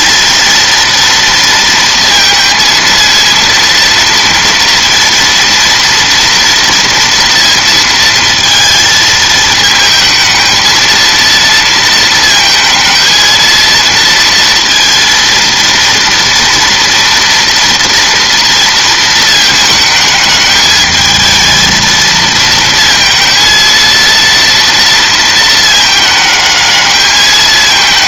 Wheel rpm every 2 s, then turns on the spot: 230, 230, 230, 230, 220, 230, 220, 230, 230, 230, 220, 230, 230, 210.
none